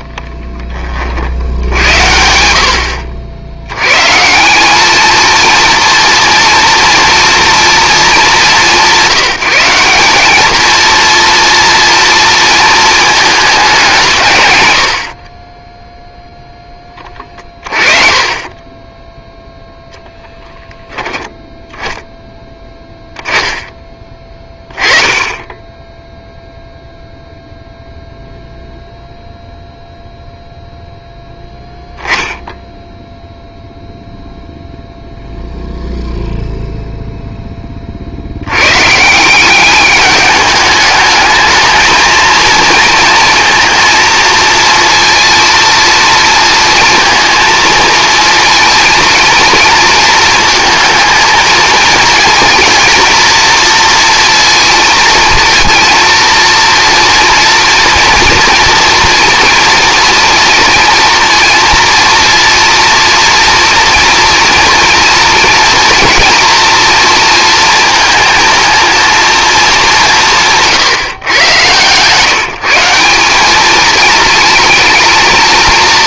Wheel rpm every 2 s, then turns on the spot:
20, 70, 190, 230, 190, 230, 220, 100, 10, 20, 10, 10, 20, 0, 0, 0, 0, 0, 0, 120, 210, 230, 230, 230, 230, 220, 230, 230, 230, 240, 230, 230, 240, 230, 230, 170, 190, 230.
none